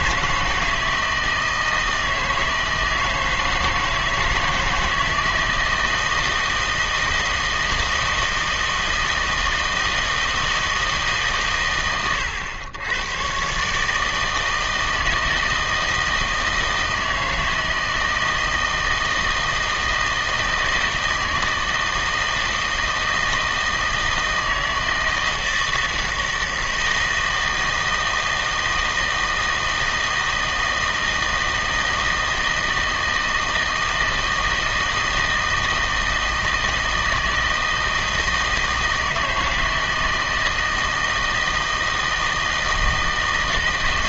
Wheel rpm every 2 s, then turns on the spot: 170, 160, 160, 160, 160, 160, 100, 160, 160, 160, 160, 160, 160, 160, 160, 160, 160, 160, 160, 160, 160, 160.
none